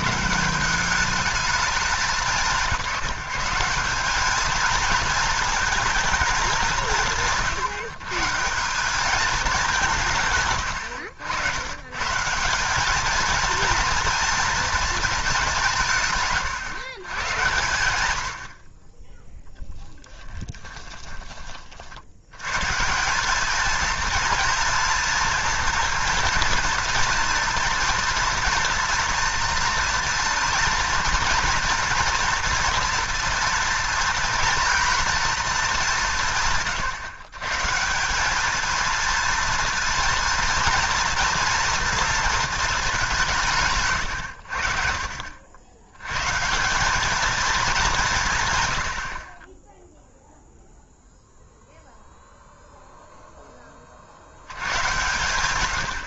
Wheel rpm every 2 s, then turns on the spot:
190, 170, 220, 190, 190, 90, 190, 220, 150, 30, 10, 120, 230, 230, 230, 230, 230, 230, 140, 220, 230, 210, 60, 160, 100, 0, 0, 120.
none